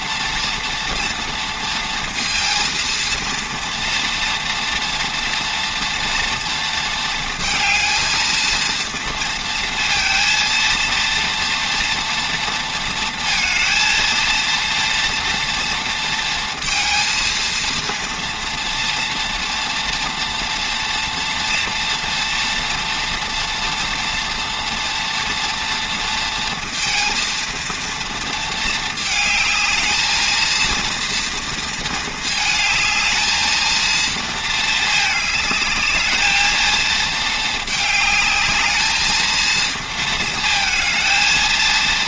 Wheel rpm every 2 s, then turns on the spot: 230, 230, 230, 230, 230, 230, 230, 230, 230, 230, 230, 240, 230, 230, 220, 230, 220, 220, 220, 220, 230.
none